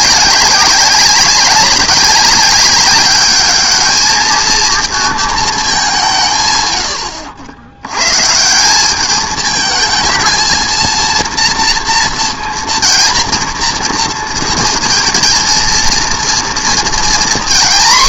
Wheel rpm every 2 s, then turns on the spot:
200, 200, 230, 90, 210, 230, 230, 230, 240.
none